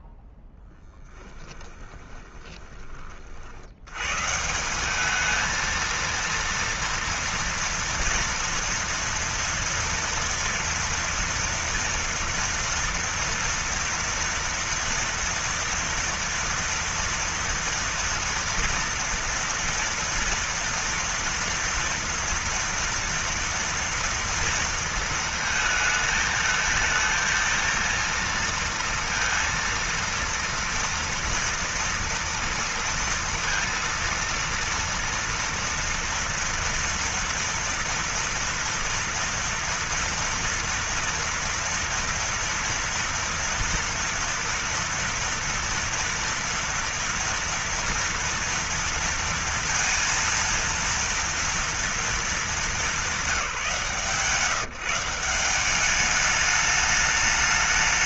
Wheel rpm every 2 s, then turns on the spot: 10, 30, 190, 230, 230, 230, 230, 230, 230, 240, 230, 240, 230, 220, 230, 230, 230, 230, 230, 230, 230, 230, 230, 230, 230, 230, 210, 180, 210.
0-2